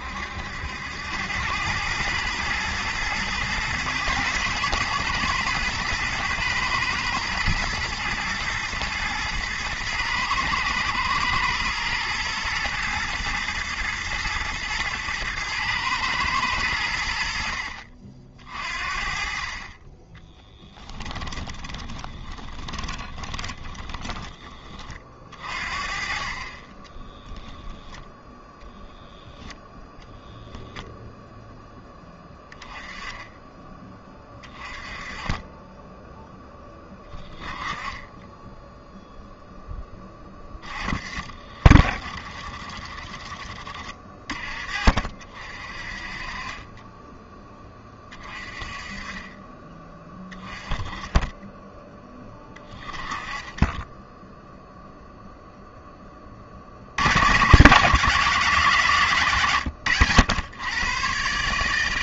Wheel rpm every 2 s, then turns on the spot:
80, 110, 120, 110, 120, 120, 120, 110, 90, 50, 10, 20, 30, 20, 0, 10, 10, 30, 20, 0, 40, 30, 40, 20, 20, 10, 20, 0, 80, 160, 110.
20-24